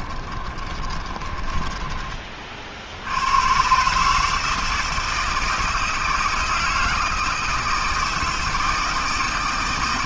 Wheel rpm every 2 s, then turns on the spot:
30, 70, 160, 160, 160.
0-2